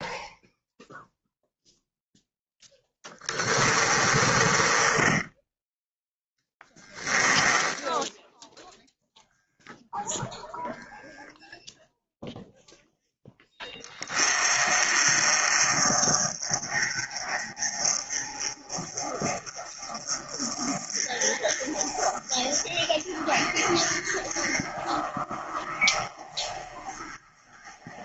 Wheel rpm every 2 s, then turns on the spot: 0, 20, 10, 10, 0, 0, 10, 40, 30, 40, 40, 40, 40, 40.
2-8